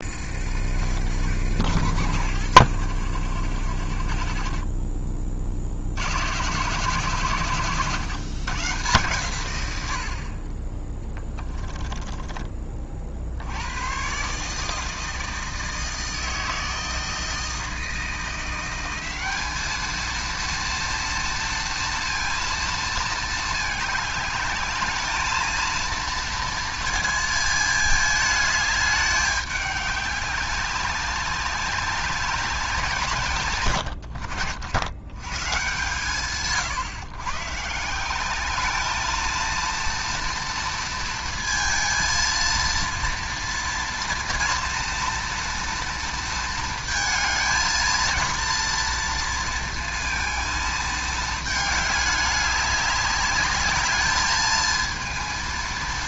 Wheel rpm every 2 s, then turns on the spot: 90, 90, 40, 130, 130, 20, 30, 150, 160, 180, 230, 230, 210, 230, 210, 190, 150, 70, 140, 210, 230, 230, 230, 230, 230, 220, 200, 220.
none